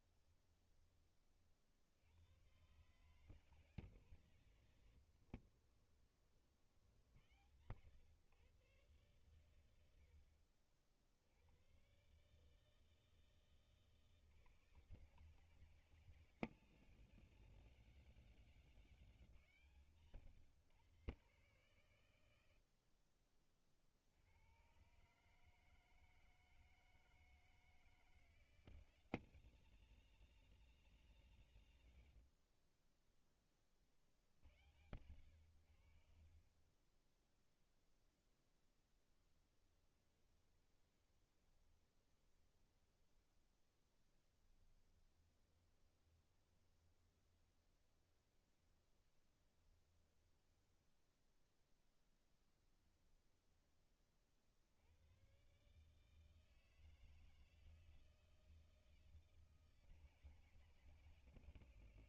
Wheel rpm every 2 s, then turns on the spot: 20, 130, 140, 70, 120, 60, 160, 150, 180, 190, 130, 70, 120, 160, 170, 180, 30, 90, 30, 10, 20, 10, 10, 20, 20, 10, 10, 80, 160, 160, 150.
4-6 36-38 40-42 44-52